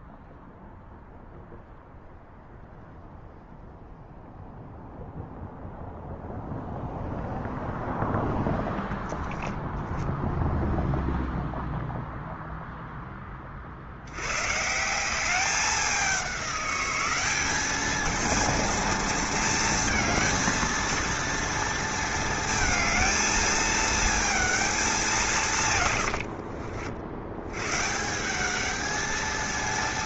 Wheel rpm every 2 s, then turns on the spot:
0, 0, 0, 0, 0, 0, 0, 150, 190, 230, 230, 220, 210, 70, 210.
none